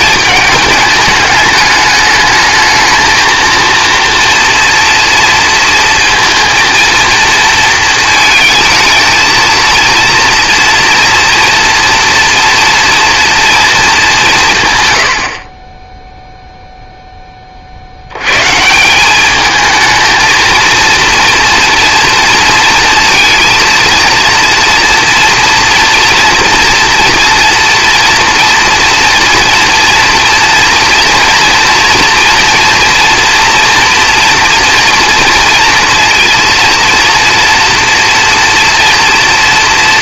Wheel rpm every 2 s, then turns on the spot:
210, 220, 230, 230, 230, 230, 240, 150, 0, 150, 230, 230, 230, 230, 230, 230, 230, 230, 230, 230.
none